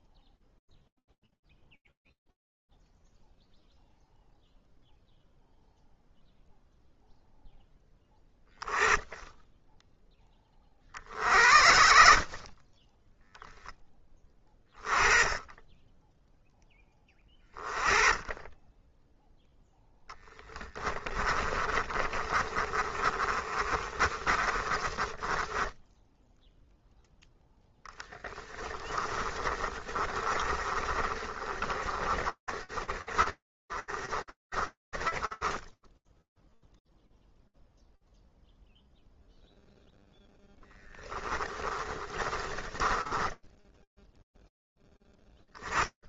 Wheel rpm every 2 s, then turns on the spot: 0, 0, 0, 0, 10, 30, 20, 20, 10, 10, 20, 30, 20, 0, 30, 30, 30, 20, 0, 0, 20, 10, 0.
20-26 28-36 40-42